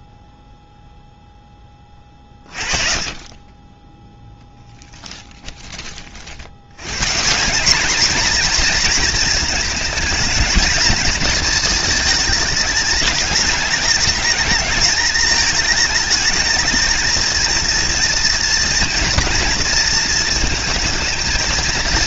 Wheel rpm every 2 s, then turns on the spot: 20, 0, 40, 230, 220, 210, 210, 210, 230, 230, 220.
none